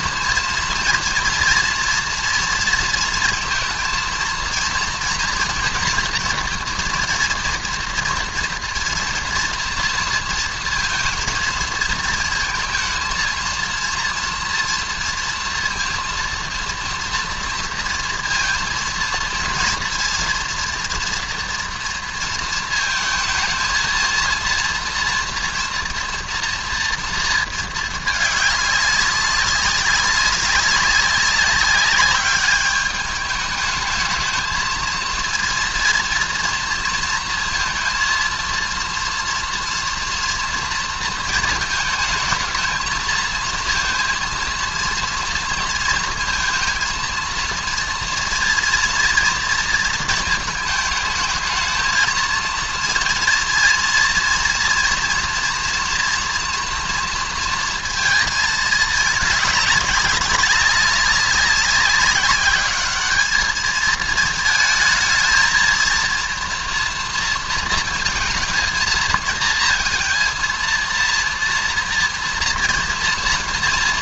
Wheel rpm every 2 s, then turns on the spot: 230, 230, 230, 230, 240, 230, 220, 230, 230, 230, 240, 220, 230, 230, 200, 190, 210, 220, 230, 230, 230, 220, 230, 230, 240, 220, 230, 240, 230, 210, 200, 210, 220, 230, 230, 230, 240.
none